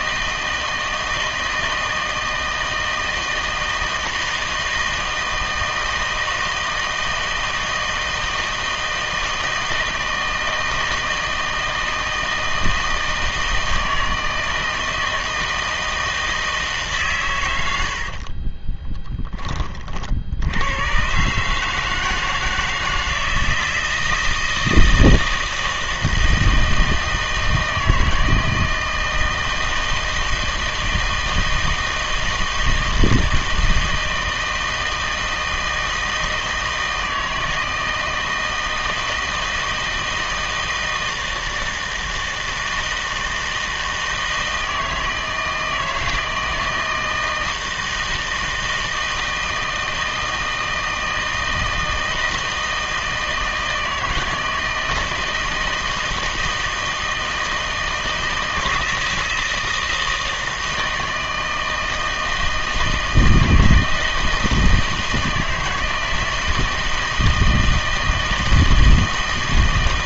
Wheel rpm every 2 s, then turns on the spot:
160, 160, 160, 160, 160, 160, 160, 160, 150, 30, 80, 160, 160, 160, 160, 160, 160, 160, 160, 160, 160, 160, 160, 160, 160, 160, 160, 160, 160, 160, 160, 160, 160, 160, 160.
18-20